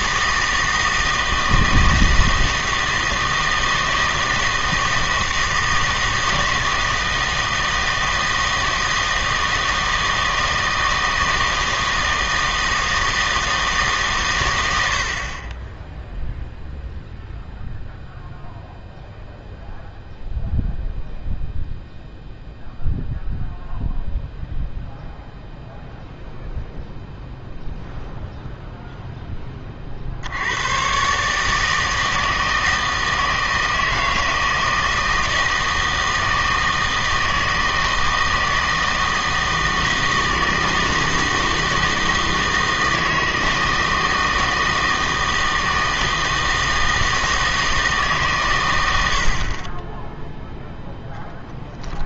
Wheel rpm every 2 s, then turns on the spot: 160, 160, 160, 160, 160, 160, 160, 90, 0, 0, 0, 0, 0, 0, 0, 110, 160, 160, 160, 160, 160, 160, 160, 160, 120, 0.
none